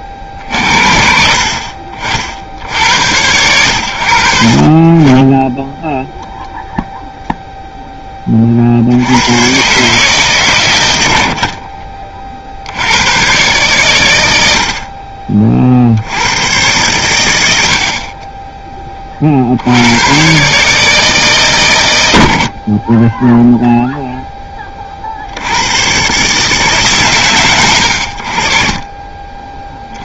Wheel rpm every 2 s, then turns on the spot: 50, 60, 50, 0, 50, 110, 70, 60, 110, 20, 140, 40, 20, 150, 40.
none